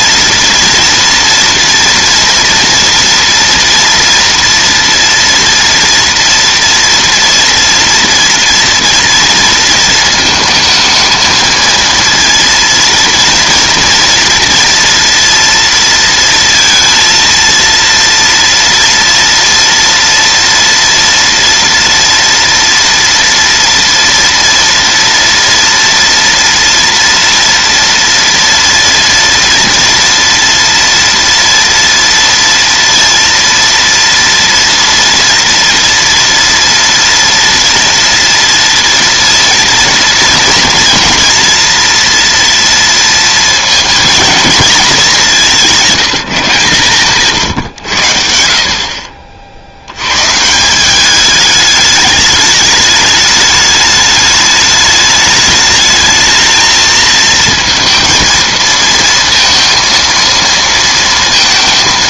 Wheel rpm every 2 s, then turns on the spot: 230, 230, 230, 230, 230, 220, 230, 230, 230, 230, 230, 230, 230, 230, 230, 240, 230, 230, 230, 230, 230, 230, 220, 160, 50, 180, 210, 210, 220, 230, 230.
none